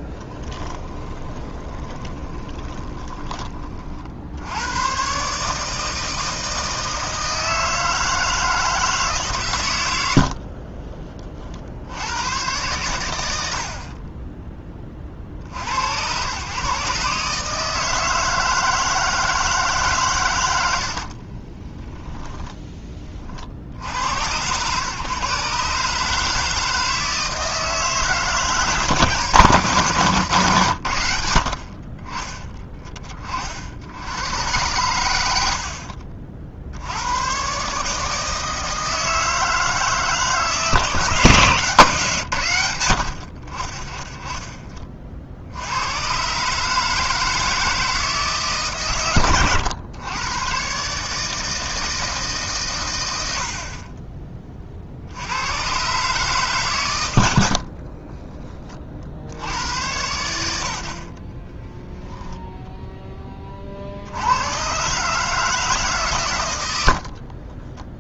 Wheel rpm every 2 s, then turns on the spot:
20, 20, 120, 160, 160, 30, 110, 20, 140, 160, 70, 20, 120, 160, 160, 90, 20, 110, 80, 160, 160, 100, 40, 150, 130, 130, 110, 50, 120, 30, 70, 10, 130, 90.
0-4 10-12 20-22